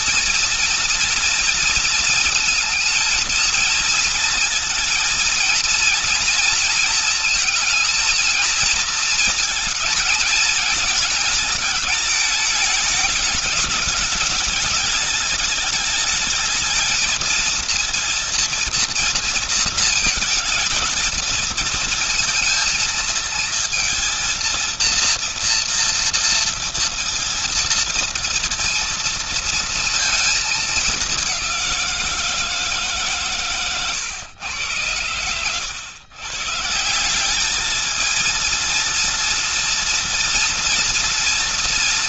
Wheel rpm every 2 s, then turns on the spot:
230, 230, 230, 230, 220, 220, 220, 210, 220, 230, 220, 230, 230, 230, 230, 210, 160, 120, 150, 230, 230.
none